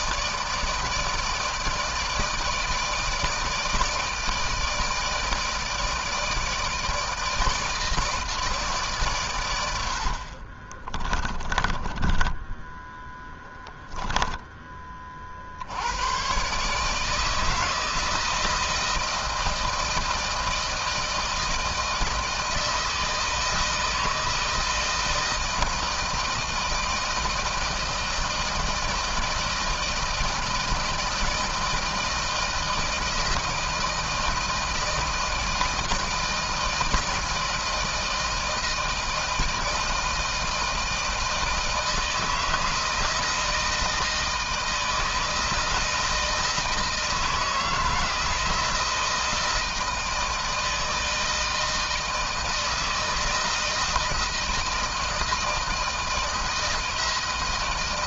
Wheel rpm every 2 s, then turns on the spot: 150, 160, 160, 160, 150, 40, 10, 20, 130, 160, 160, 160, 160, 160, 160, 160, 160, 160, 160, 160, 160, 160, 160, 160, 170, 160, 160, 160, 160.
10-14